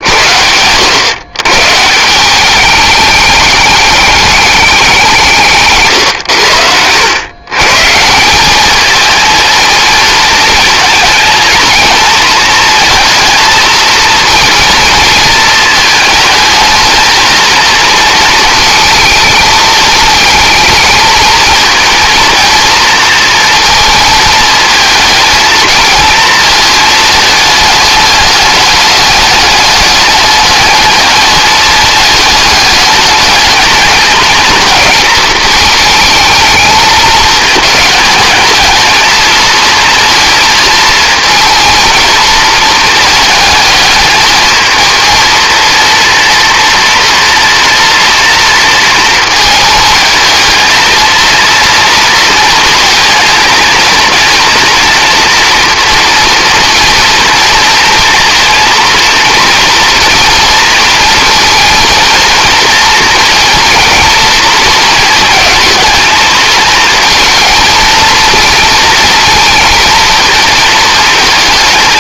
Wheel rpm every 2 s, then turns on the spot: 110, 210, 190, 100, 210, 230, 230, 230, 220, 220, 220, 230, 220, 220, 210, 210, 210, 220, 220, 220, 220, 220, 220, 230, 230, 230, 230, 230, 230, 230, 230, 230, 220, 230, 230, 220.
none